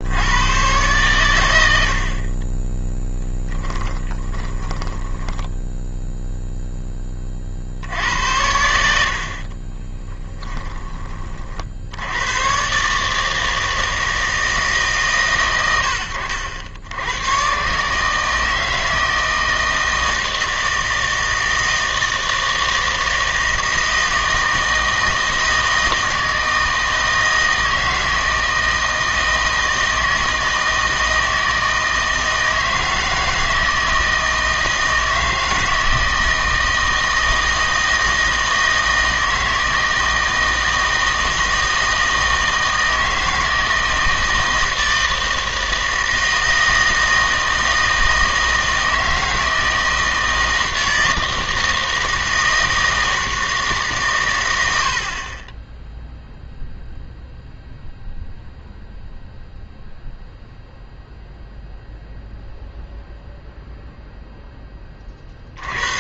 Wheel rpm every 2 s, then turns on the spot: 120, 20, 20, 0, 80, 10, 120, 150, 80, 160, 160, 160, 160, 160, 160, 160, 160, 160, 160, 160, 160, 160, 160, 160, 160, 160, 160, 90, 0, 0, 0, 0, 10.
4-6 10-12